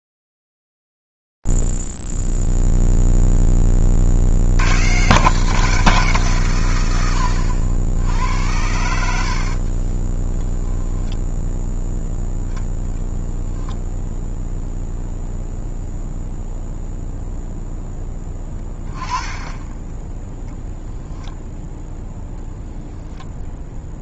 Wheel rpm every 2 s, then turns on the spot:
0, 0, 50, 160, 80, 20, 0, 0, 0, 10, 0, 10.
10-12